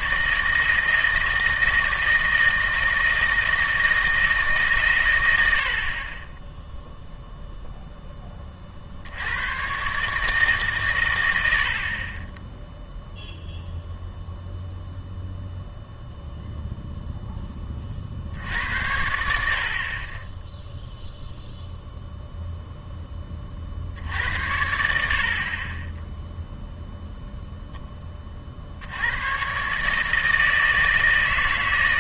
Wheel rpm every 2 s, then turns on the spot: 160, 160, 140, 0, 40, 140, 0, 0, 0, 80, 10, 0, 80, 0, 60, 160.
none